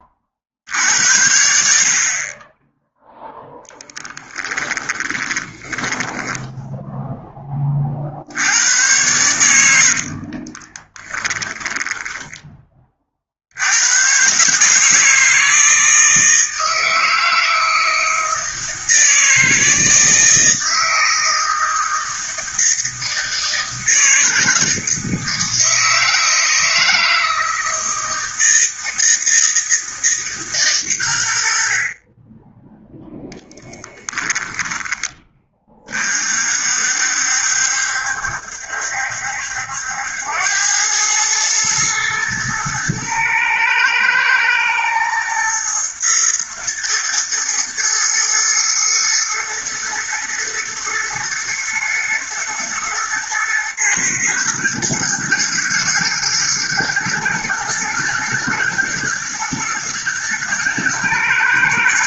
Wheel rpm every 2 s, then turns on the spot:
70, 10, 20, 0, 100, 20, 30, 150, 160, 160, 160, 160, 160, 160, 160, 130, 10, 10, 60, 70, 100, 110, 110, 110, 110, 110, 110, 110, 110, 110, 110.
4-6 10-12